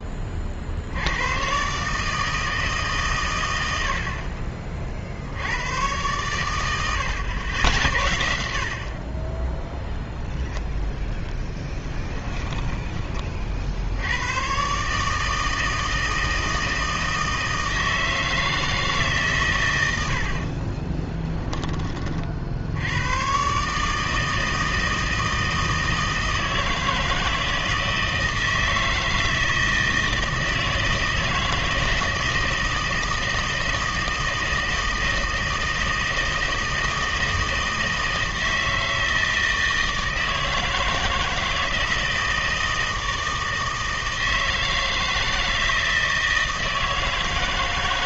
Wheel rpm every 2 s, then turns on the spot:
50, 150, 40, 110, 60, 0, 10, 120, 160, 160, 40, 60, 160, 160, 160, 160, 160, 160, 160, 160, 160, 160, 160, 160.
12-14 20-22